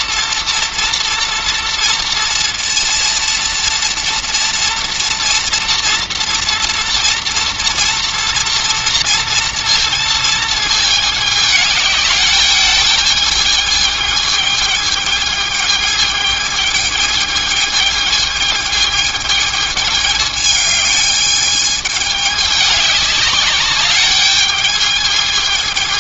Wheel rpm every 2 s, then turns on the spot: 230, 230, 230, 230, 230, 220, 210, 220, 220, 220, 210, 200, 210.
none